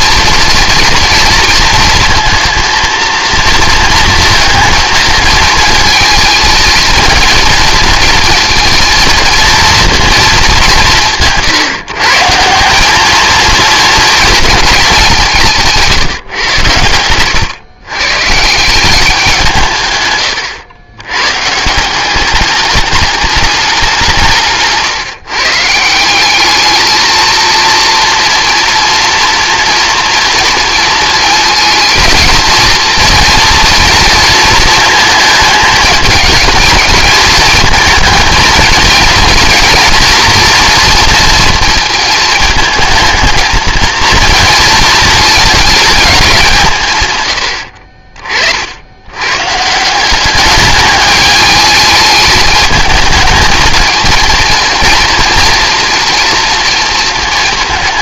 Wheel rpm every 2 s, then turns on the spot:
230, 230, 220, 230, 230, 170, 200, 220, 100, 190, 110, 210, 150, 220, 230, 220, 230, 220, 220, 230, 230, 220, 230, 140, 80, 210, 220, 230, 230.
16-18